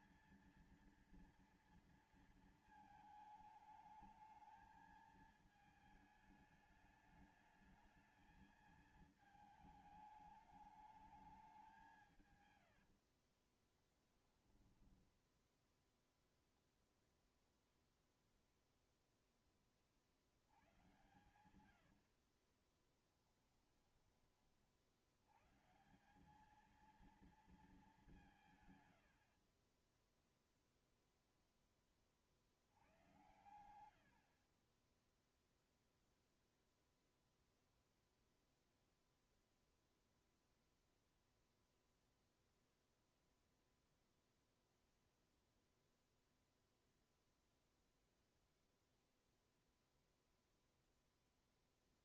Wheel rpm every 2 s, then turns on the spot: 230, 230, 220, 210, 220, 210, 110, 10, 0, 0, 70, 40, 40, 200, 160, 0, 60, 50, 0, 0, 0, 0, 0, 0, 0, 0.
12-14 22-24 34-36